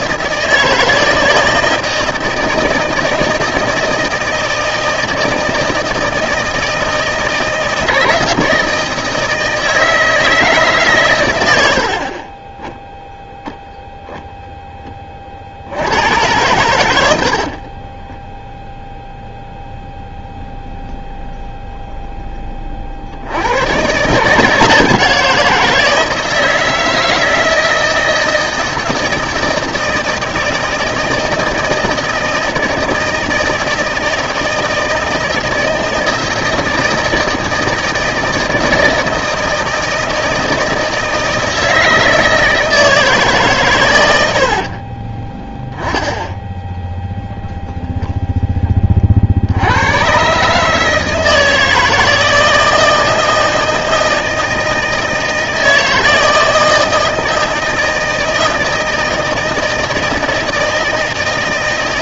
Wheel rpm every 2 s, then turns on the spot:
160, 160, 160, 160, 160, 140, 0, 10, 100, 10, 0, 30, 170, 160, 160, 160, 160, 160, 160, 160, 160, 160, 60, 0, 20, 150, 160, 160, 160, 160, 160.
44-46